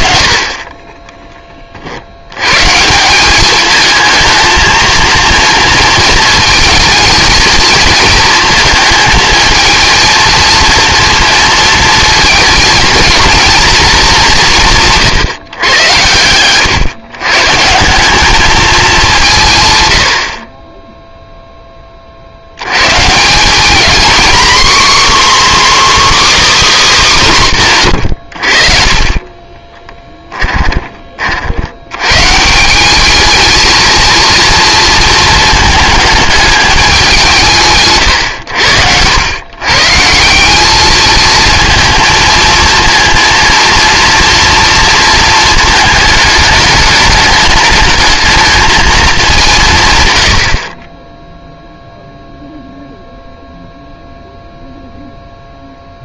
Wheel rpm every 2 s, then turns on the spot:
20, 140, 220, 230, 220, 230, 230, 170, 120, 210, 10, 110, 270, 280, 50, 20, 180, 230, 200, 90, 210, 230, 230, 210, 220, 30, 0, 0.
none